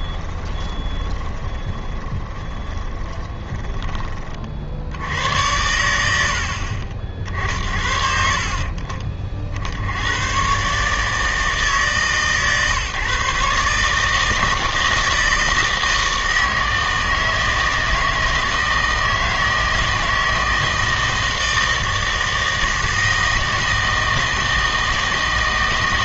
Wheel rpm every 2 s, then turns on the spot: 20, 20, 60, 50, 40, 130, 140, 160, 160, 160, 160, 160, 160.
0-4